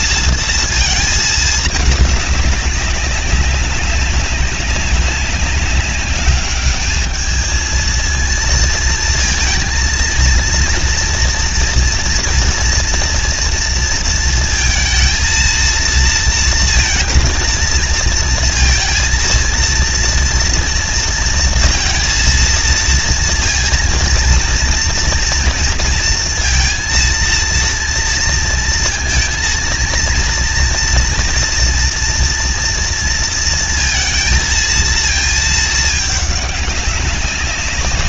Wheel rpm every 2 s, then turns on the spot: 230, 200, 200, 210, 230, 230, 240, 230, 230, 230, 230, 230, 230, 230, 230, 230, 240, 230, 200.
none